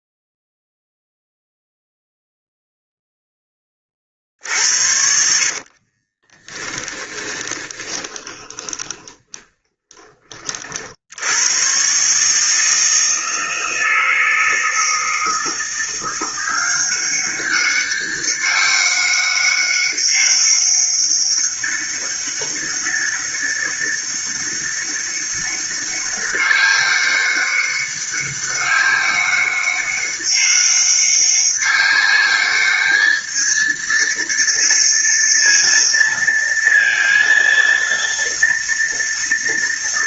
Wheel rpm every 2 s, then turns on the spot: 0, 0, 70, 10, 20, 60, 160, 160, 190, 200, 200, 200, 200, 200, 200, 200, 210, 230, 230, 230.
4-10